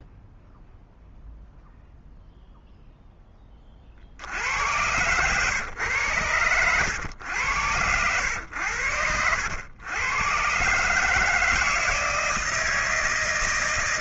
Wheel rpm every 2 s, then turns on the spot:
0, 0, 90, 110, 100, 140, 160.
8-10